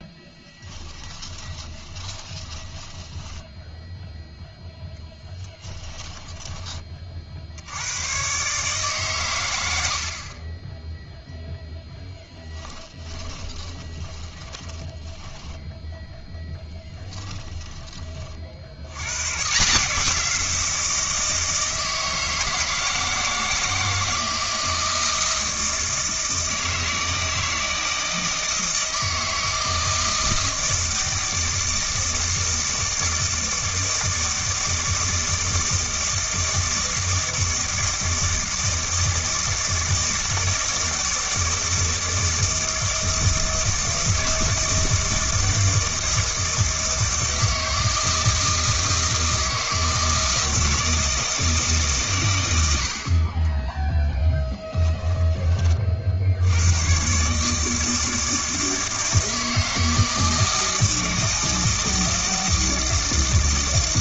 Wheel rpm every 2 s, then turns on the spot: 10, 10, 0, 20, 140, 10, 20, 20, 10, 60, 170, 160, 160, 160, 160, 160, 160, 160, 160, 160, 160, 160, 160, 160, 160, 160, 90, 10, 100, 160, 160, 160.
0-4 12-16 54-56